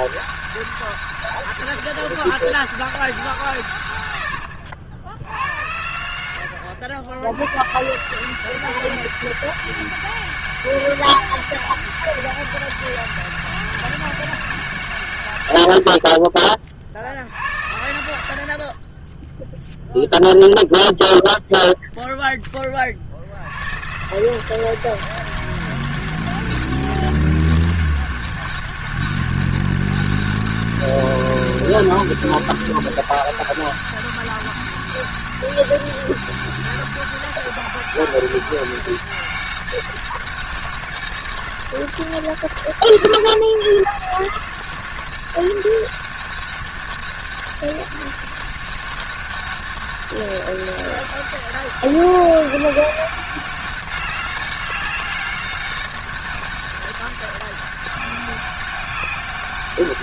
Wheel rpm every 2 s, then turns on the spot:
200, 200, 90, 100, 180, 200, 200, 190, 40, 70, 0, 10, 170, 190, 200, 200, 200, 200, 200, 200, 200, 160, 170, 190, 200, 200, 200, 200, 200, 200.
none